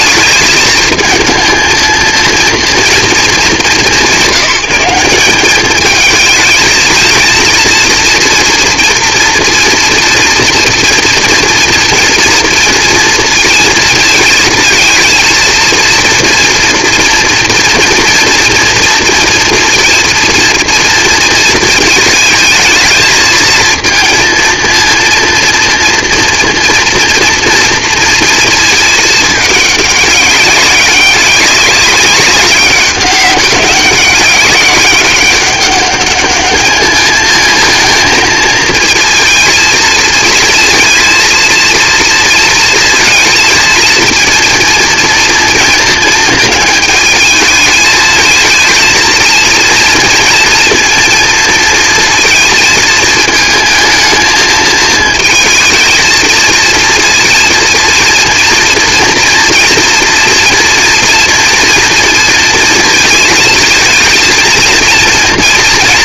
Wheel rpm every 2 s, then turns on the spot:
220, 230, 190, 220, 230, 230, 230, 230, 230, 230, 230, 220, 230, 230, 230, 200, 200, 200, 210, 230, 230, 230, 240, 220, 230, 230, 230, 220, 230, 230, 230, 230, 230.
none